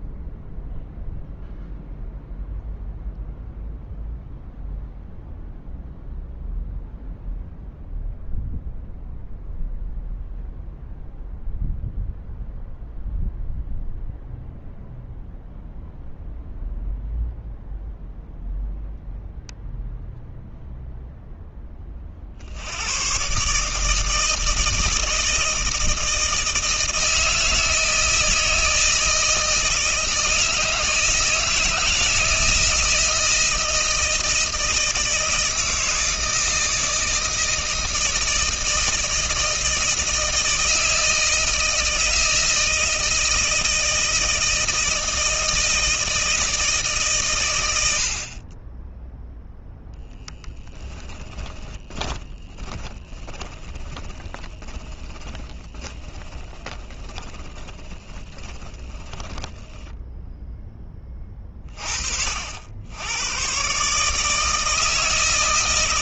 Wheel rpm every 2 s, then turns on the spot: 0, 0, 0, 0, 0, 0, 0, 0, 0, 0, 0, 110, 160, 160, 160, 160, 160, 160, 160, 160, 160, 160, 160, 140, 10, 10, 20, 20, 20, 10, 20, 90, 160.
50-60